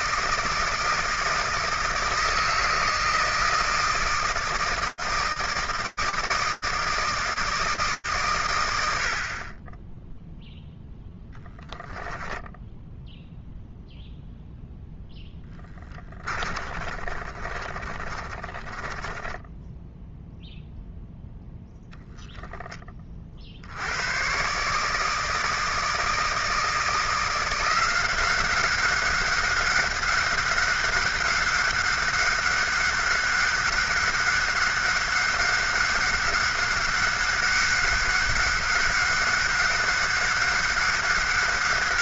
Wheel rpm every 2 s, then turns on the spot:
160, 160, 160, 160, 130, 0, 0, 0, 20, 20, 0, 20, 150, 160, 190, 190, 190, 190, 190, 200, 200.
16-20